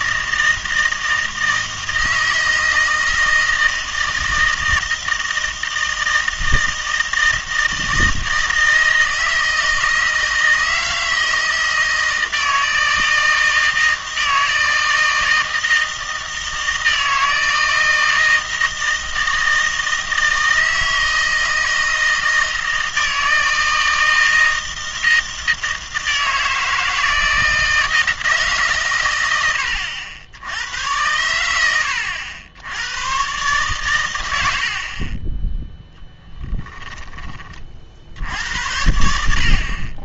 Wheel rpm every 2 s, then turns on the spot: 160, 160, 160, 160, 160, 160, 160, 160, 160, 160, 160, 160, 160, 160, 140, 90, 90, 60, 0, 80.
none